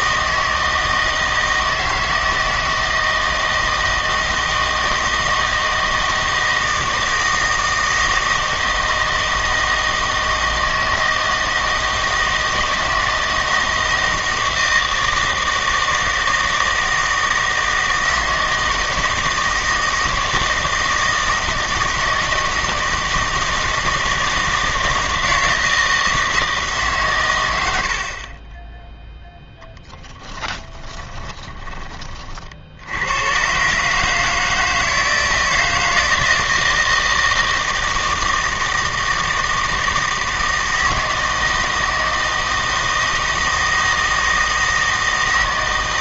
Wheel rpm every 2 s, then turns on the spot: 160, 160, 160, 160, 160, 160, 160, 160, 160, 160, 160, 160, 160, 150, 10, 10, 70, 160, 160, 160, 160, 160, 160.
30-32